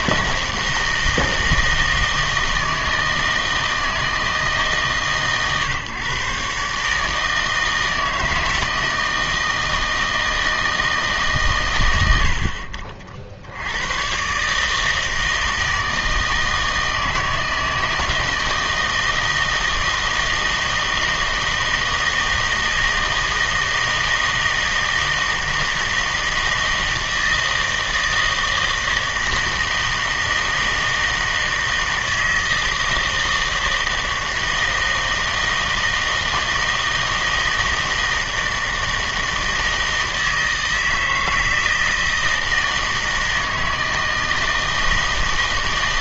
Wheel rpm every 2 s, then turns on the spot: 160, 160, 150, 140, 160, 160, 50, 150, 160, 160, 160, 160, 160, 160, 160, 160, 160, 160, 160, 160, 160, 160, 160.
none